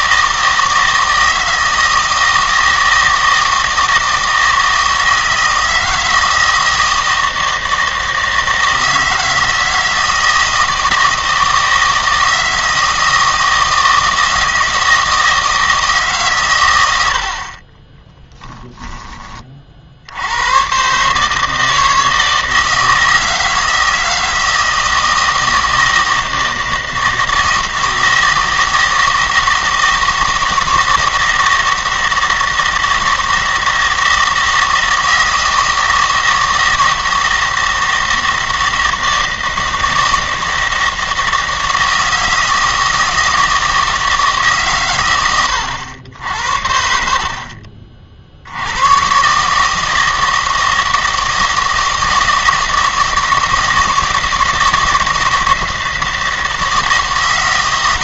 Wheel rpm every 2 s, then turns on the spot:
160, 160, 160, 160, 160, 160, 160, 160, 90, 10, 130, 160, 160, 160, 160, 160, 160, 160, 160, 160, 160, 160, 130, 70, 120, 160, 160, 160, 160.
none